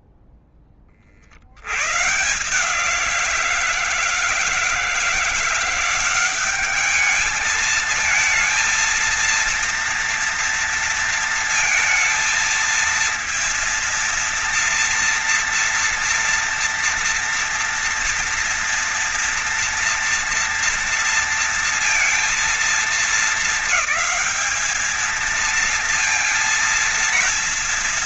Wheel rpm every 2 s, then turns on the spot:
0, 140, 160, 190, 220, 230, 230, 230, 230, 230, 230, 230, 210, 230.
none